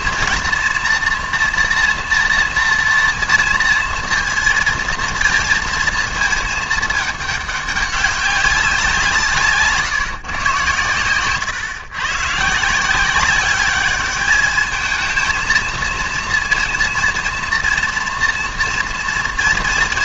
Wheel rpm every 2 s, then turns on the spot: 240, 230, 230, 220, 180, 120, 160, 220, 230, 230.
none